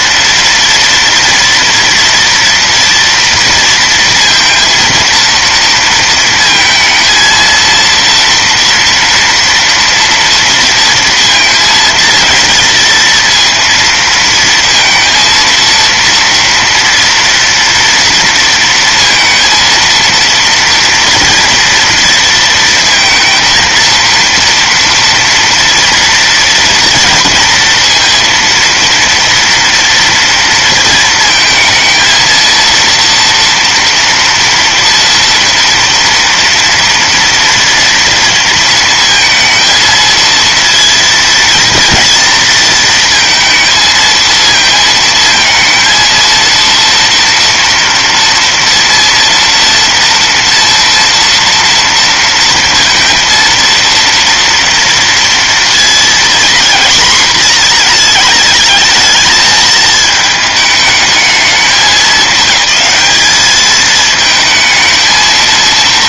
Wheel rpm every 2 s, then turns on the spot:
230, 230, 230, 230, 230, 230, 230, 230, 230, 230, 230, 230, 230, 230, 230, 230, 230, 230, 230, 230, 230, 220, 220, 230, 230, 240, 230, 230, 230, 220, 220, 210, 220.
none